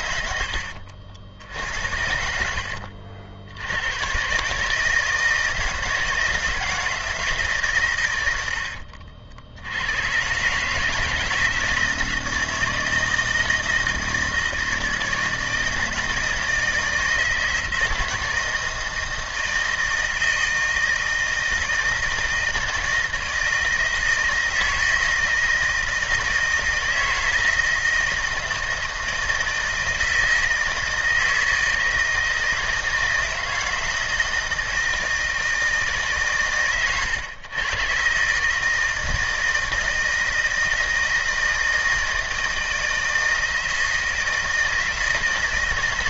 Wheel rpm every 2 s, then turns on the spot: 80, 60, 160, 160, 60, 160, 160, 160, 160, 170, 160, 160, 160, 160, 170, 160, 160, 160, 120, 160, 160, 160, 160.
0-2 8-10